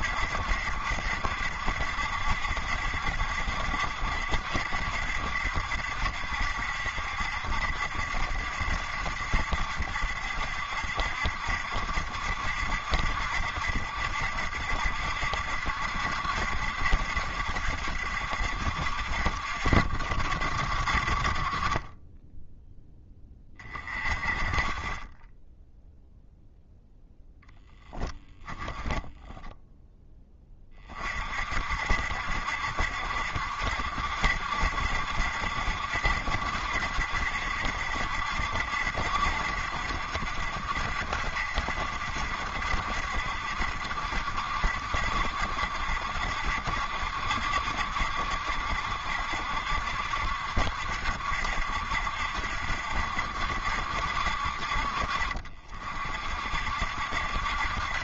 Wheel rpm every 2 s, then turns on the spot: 70, 70, 70, 70, 70, 70, 60, 70, 70, 70, 60, 10, 30, 0, 20, 20, 70, 70, 60, 70, 70, 60, 70, 70, 70, 60, 70, 60, 60.
28-30